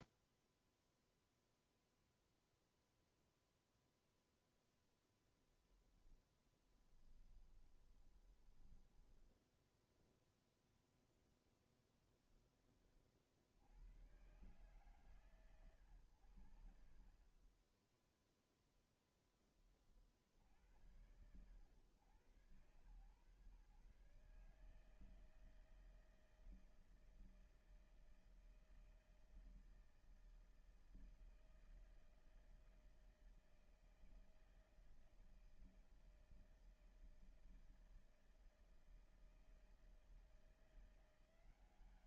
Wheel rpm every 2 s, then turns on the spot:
0, 0, 0, 10, 10, 0, 0, 110, 80, 0, 80, 120, 150, 160, 160, 160, 160, 160, 160, 160, 160.
8-10